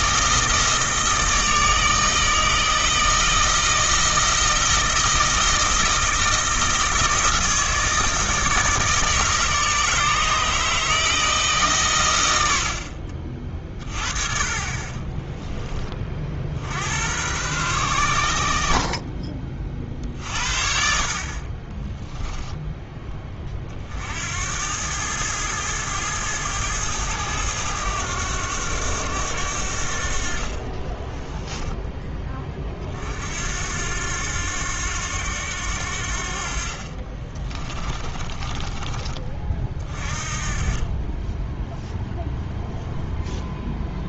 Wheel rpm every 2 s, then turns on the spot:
160, 160, 160, 160, 160, 160, 70, 30, 70, 60, 50, 10, 90, 110, 100, 50, 40, 90, 50, 20, 30, 0.
30-32 38-40